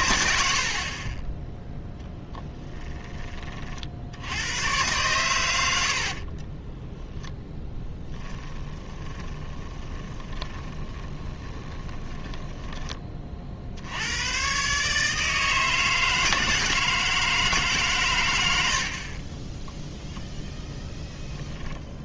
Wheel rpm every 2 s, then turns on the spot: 50, 20, 110, 10, 20, 20, 10, 130, 160, 80, 0.
2-4 6-12